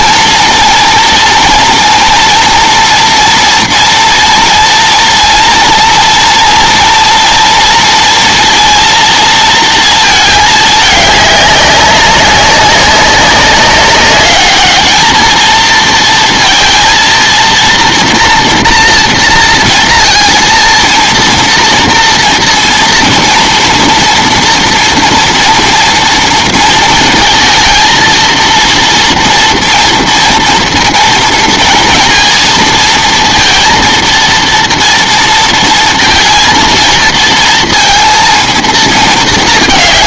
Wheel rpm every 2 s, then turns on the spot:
230, 230, 230, 230, 230, 210, 200, 220, 230, 230, 230, 230, 240, 230, 230, 230, 230, 230, 230, 220.
none